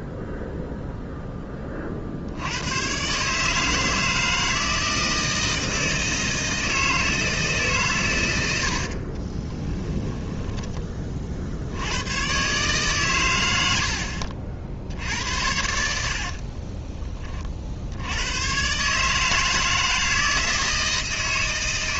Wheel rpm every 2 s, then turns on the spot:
0, 80, 160, 160, 80, 10, 130, 60, 40, 120, 160.
8-10 16-18